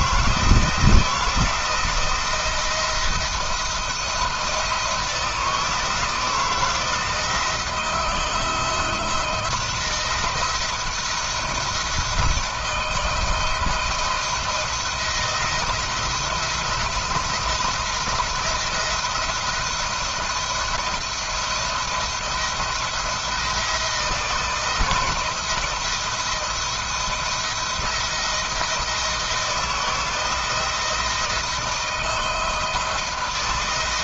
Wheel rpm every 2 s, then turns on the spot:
170, 170, 160, 170, 170, 170, 170, 160, 170, 170, 170, 170, 160, 170, 160, 160, 160.
none